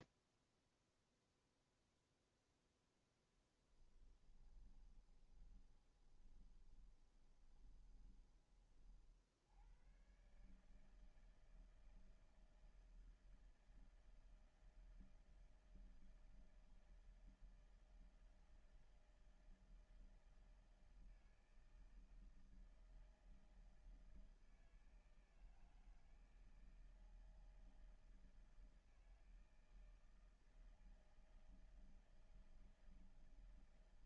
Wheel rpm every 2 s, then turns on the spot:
0, 0, 20, 30, 40, 150, 160, 160, 160, 160, 160, 160, 160, 160, 160, 160, 160.
4-8